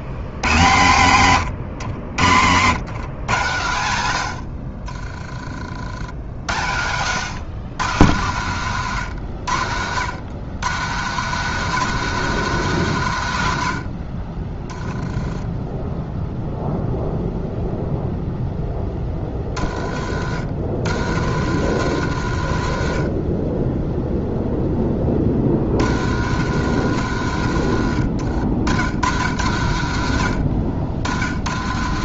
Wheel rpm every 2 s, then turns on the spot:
130, 100, 70, 100, 110, 140, 170, 20, 0, 10, 60, 60, 10, 90, 70, 70.
4-6